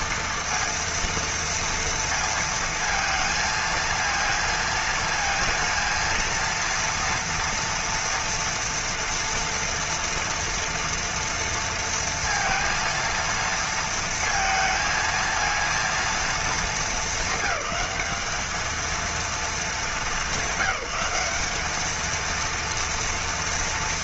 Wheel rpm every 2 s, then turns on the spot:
230, 230, 230, 230, 240, 230, 230, 230, 230, 220, 200, 230.
none